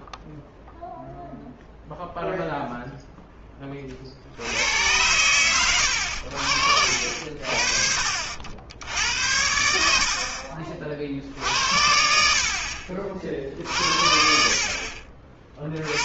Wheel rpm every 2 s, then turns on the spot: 0, 0, 80, 70, 60, 30, 20, 60.
none